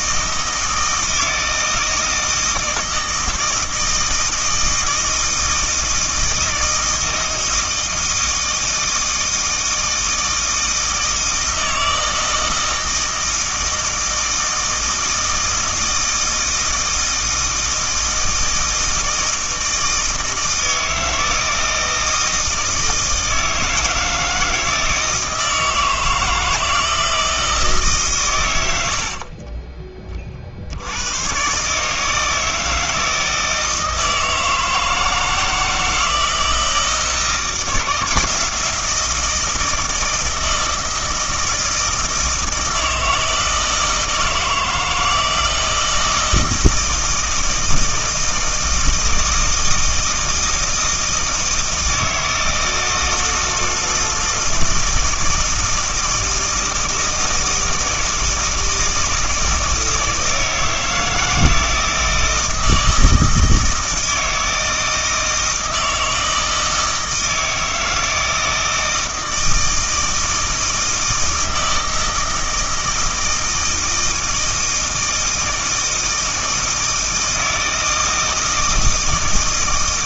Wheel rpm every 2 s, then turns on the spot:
160, 160, 160, 160, 160, 160, 160, 160, 160, 160, 160, 160, 160, 160, 90, 60, 160, 160, 160, 170, 160, 160, 160, 160, 160, 160, 160, 160, 160, 160, 160, 160, 160, 160, 160, 160, 160, 160, 160, 160.
none